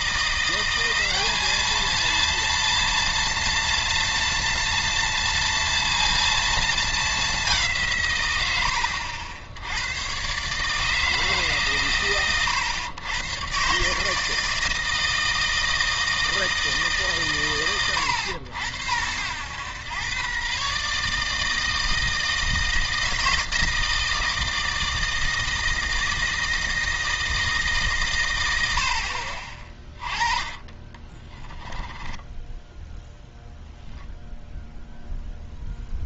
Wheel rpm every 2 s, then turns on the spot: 180, 230, 230, 220, 80, 150, 120, 160, 150, 90, 140, 160, 160, 160, 80, 20, 10, 0.
28-34